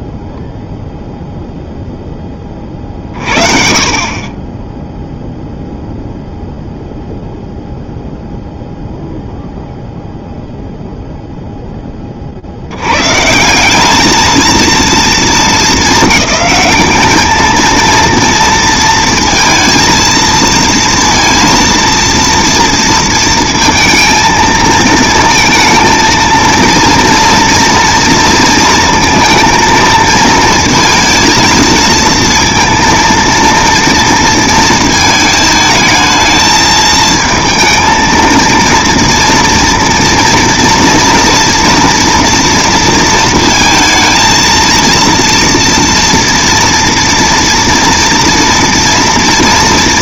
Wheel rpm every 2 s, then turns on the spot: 0, 20, 20, 0, 0, 0, 80, 230, 210, 230, 230, 230, 230, 230, 230, 230, 230, 220, 220, 230, 230, 230, 230, 230, 230.
none